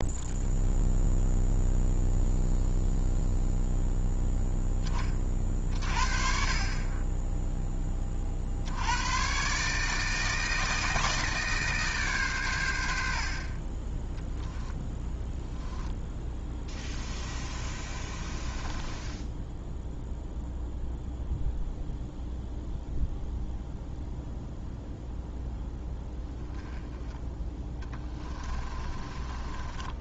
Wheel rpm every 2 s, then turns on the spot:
0, 0, 20, 20, 80, 160, 100, 10, 20, 20, 0, 0, 0, 10, 30.
14-20 28-30